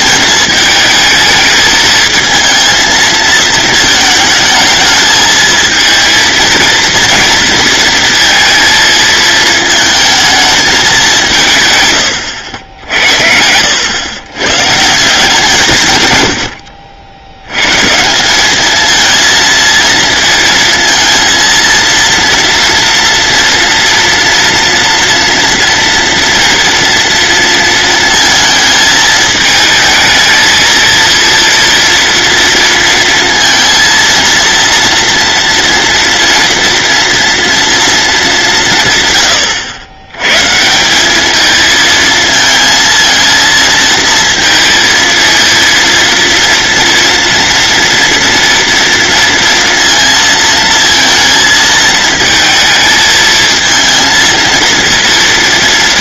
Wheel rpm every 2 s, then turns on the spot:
220, 220, 220, 230, 230, 210, 70, 140, 70, 220, 230, 240, 230, 230, 220, 230, 230, 230, 240, 140, 180, 220, 230, 230, 230, 230, 230, 230.
none